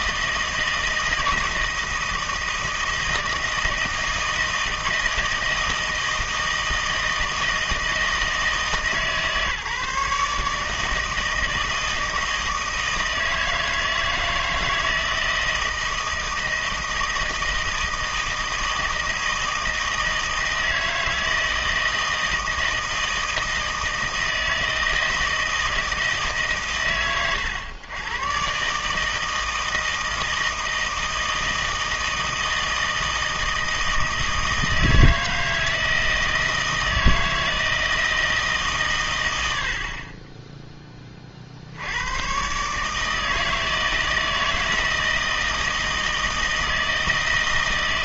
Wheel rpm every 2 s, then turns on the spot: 160, 160, 160, 160, 160, 160, 160, 160, 160, 160, 160, 160, 160, 130, 160, 160, 160, 160, 160, 140, 20, 140, 160, 160.
none